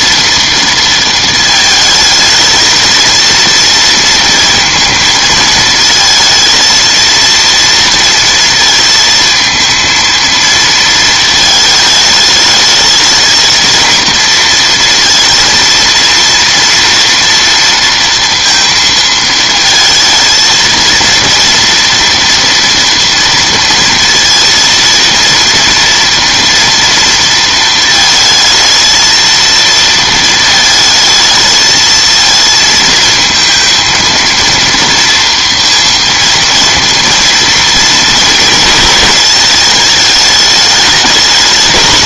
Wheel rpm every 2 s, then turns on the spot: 230, 220, 220, 230, 230, 220, 220, 230, 230, 230, 230, 230, 230, 230, 220, 220, 230, 230, 230, 210, 210.
none